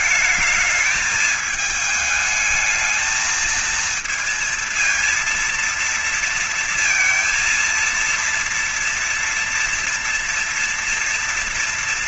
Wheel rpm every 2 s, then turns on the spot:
210, 220, 230, 230, 230, 230.
none